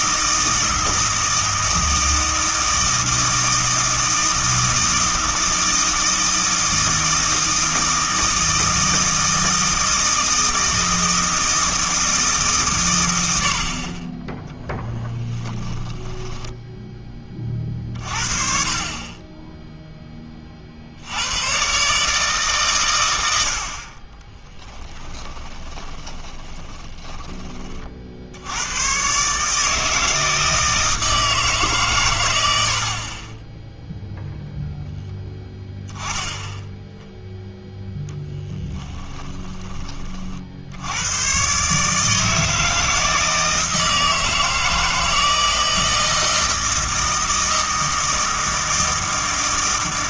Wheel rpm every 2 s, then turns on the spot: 160, 160, 160, 160, 160, 160, 110, 10, 10, 50, 50, 130, 20, 20, 110, 160, 70, 0, 0, 10, 80, 160, 160, 160, 160.
24-28 38-40